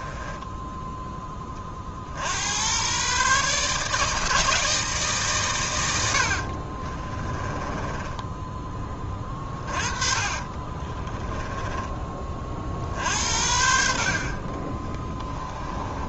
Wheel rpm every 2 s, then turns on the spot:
10, 100, 160, 50, 20, 20, 50, 30.
6-8 10-12